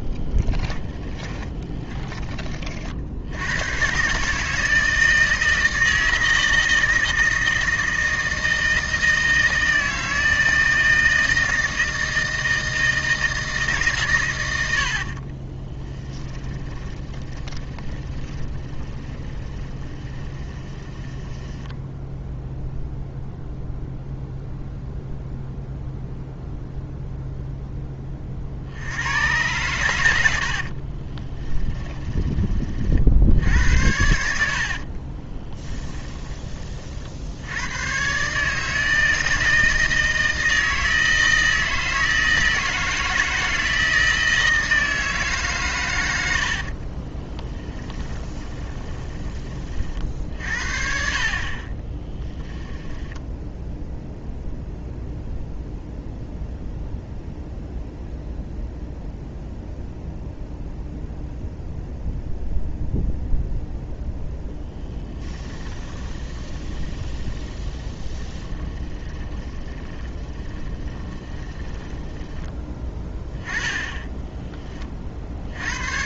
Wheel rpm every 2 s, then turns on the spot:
20, 50, 160, 160, 160, 160, 160, 70, 30, 20, 10, 0, 0, 0, 80, 40, 40, 50, 40, 150, 160, 160, 160, 50, 20, 50, 10, 0, 0, 0, 0, 0, 10, 10, 20, 30, 10, 20.
0-2 14-22 30-32 34-36 46-50 52-54 64-72